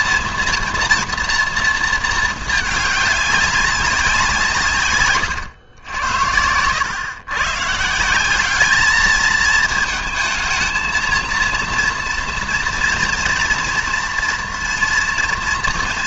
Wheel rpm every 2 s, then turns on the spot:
240, 220, 140, 100, 200, 220, 240, 230.
none